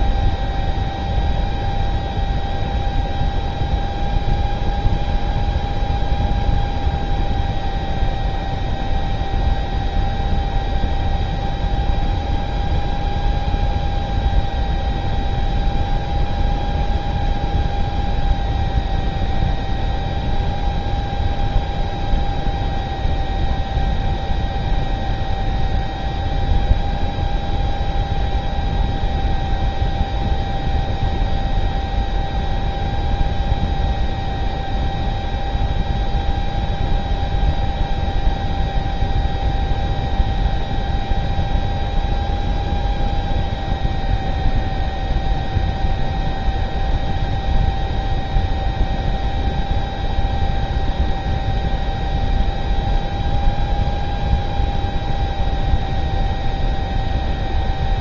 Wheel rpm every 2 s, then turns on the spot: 0, 0, 0, 0, 0, 0, 0, 0, 0, 0, 0, 0, 0, 0, 0, 0, 0, 0, 0, 0, 0, 0, 0, 0, 0, 0, 0, 0, 0.
none